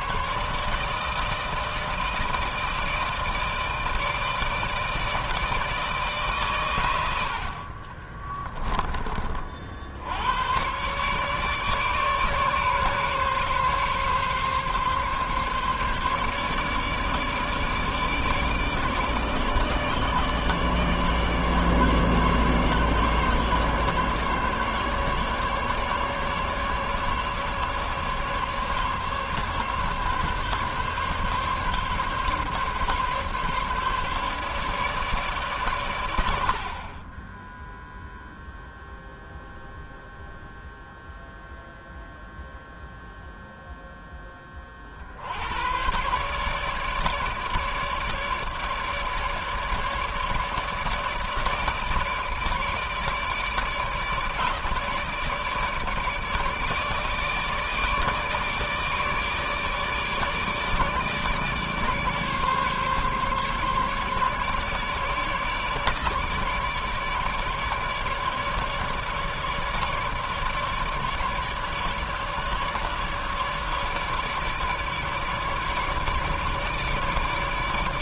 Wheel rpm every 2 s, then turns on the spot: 150, 160, 160, 130, 20, 110, 140, 140, 150, 150, 150, 140, 140, 150, 150, 140, 140, 150, 70, 0, 0, 0, 20, 130, 150, 150, 150, 150, 150, 150, 150, 140, 150, 150, 150, 150, 150, 150, 150.
8-10